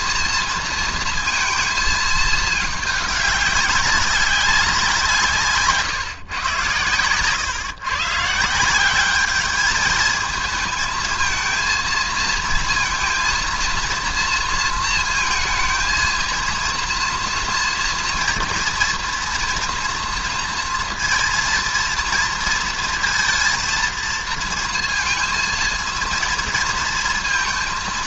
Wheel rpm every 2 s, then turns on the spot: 230, 210, 180, 120, 180, 220, 230, 230, 230, 240, 230, 230, 230, 230.
none